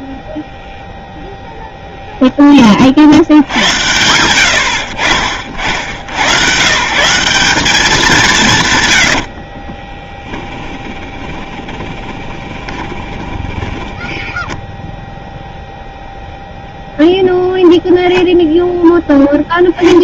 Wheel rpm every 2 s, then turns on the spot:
0, 50, 60, 150, 120, 10, 20, 0, 0, 0.
8-14